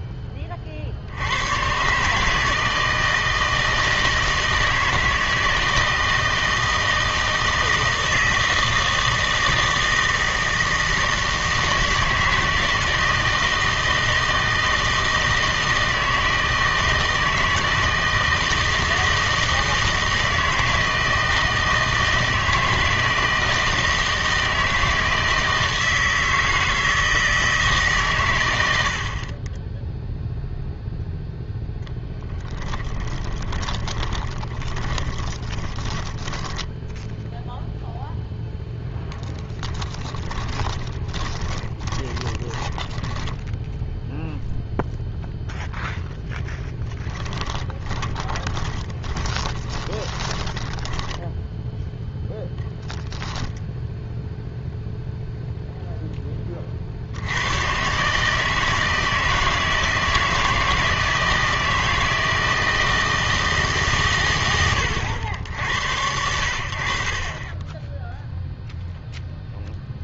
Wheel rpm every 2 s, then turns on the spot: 30, 160, 160, 160, 160, 160, 160, 160, 160, 160, 160, 160, 160, 160, 110, 0, 10, 20, 20, 0, 20, 20, 0, 0, 20, 10, 0, 0, 20, 160, 160, 160, 120, 70, 0.
32-38 40-44 48-52